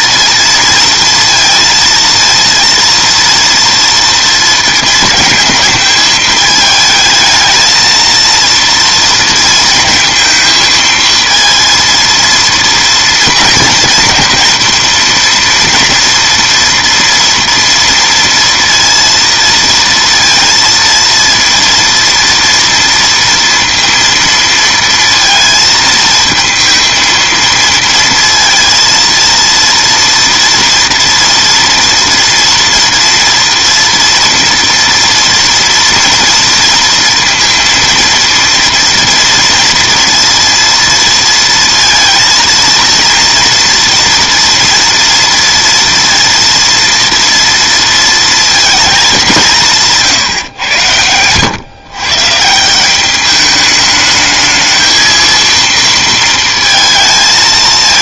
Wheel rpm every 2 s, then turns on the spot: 230, 230, 220, 220, 230, 220, 230, 230, 230, 230, 230, 230, 230, 230, 230, 230, 240, 230, 230, 230, 230, 230, 230, 230, 230, 120, 170, 220, 230.
none